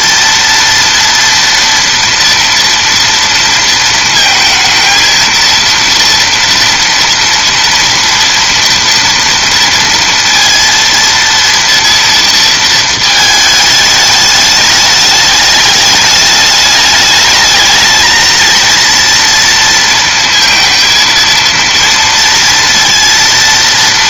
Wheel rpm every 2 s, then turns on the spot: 230, 230, 230, 230, 230, 230, 230, 210, 210, 230, 230, 230.
none